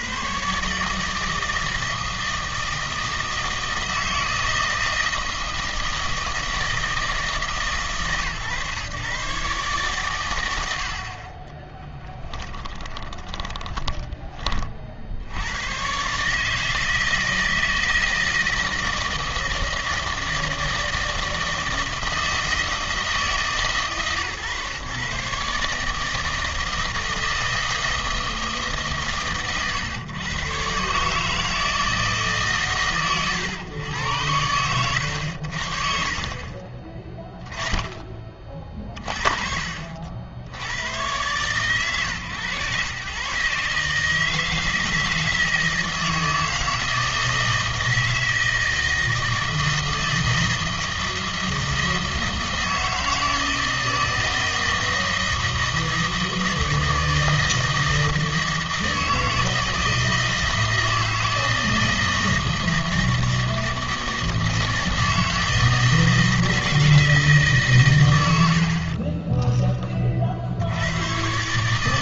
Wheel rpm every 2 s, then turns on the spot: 140, 160, 160, 160, 130, 80, 20, 40, 160, 160, 160, 160, 140, 160, 150, 130, 140, 90, 30, 30, 90, 120, 160, 160, 160, 160, 160, 160, 160, 160, 160, 160, 160, 160, 70, 80.
12-14 36-38 68-70